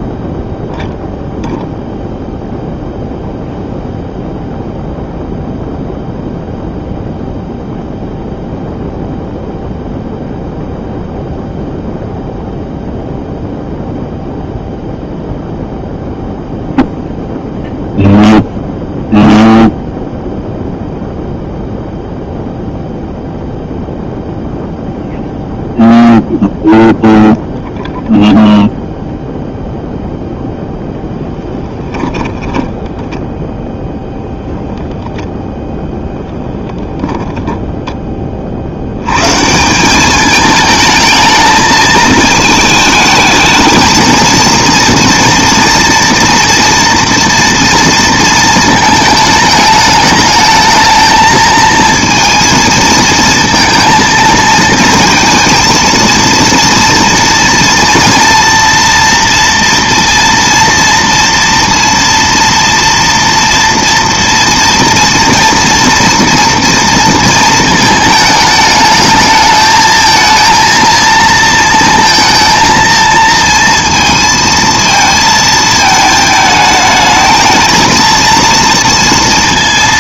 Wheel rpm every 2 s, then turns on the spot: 0, 0, 0, 0, 0, 0, 0, 0, 0, 0, 0, 0, 0, 0, 0, 0, 10, 0, 0, 60, 220, 220, 230, 230, 220, 220, 230, 230, 230, 230, 230, 230, 240, 230, 210, 220, 230, 230, 220, 230.
32-34